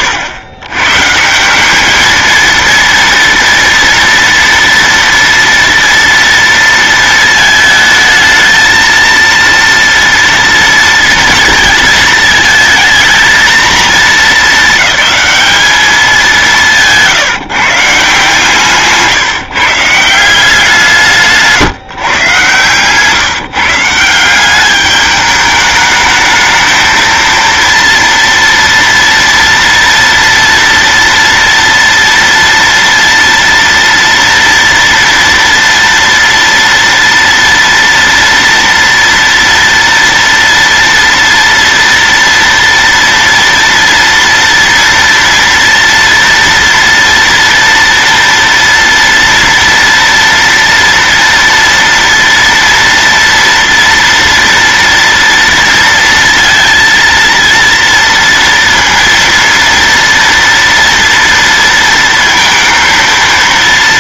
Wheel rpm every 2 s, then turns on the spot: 110, 230, 230, 230, 220, 230, 220, 220, 170, 160, 160, 140, 200, 220, 230, 230, 230, 230, 230, 230, 230, 230, 230, 230, 230, 230, 230, 230, 230, 230, 230, 230.
18-20